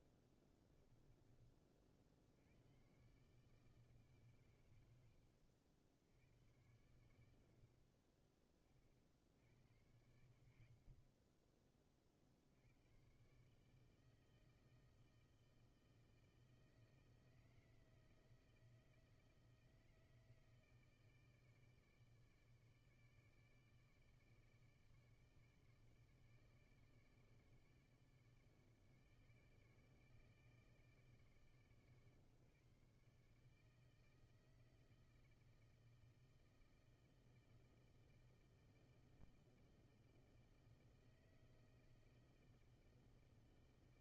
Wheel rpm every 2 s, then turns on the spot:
30, 90, 120, 90, 40, 80, 80, 160, 160, 160, 160, 150, 150, 150, 150, 150, 140, 160, 160, 160, 160, 160.
0-2